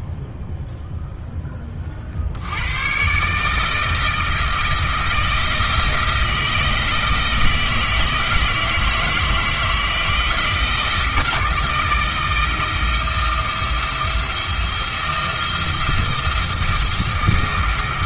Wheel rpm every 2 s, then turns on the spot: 0, 110, 160, 160, 160, 160, 160, 170, 170.
none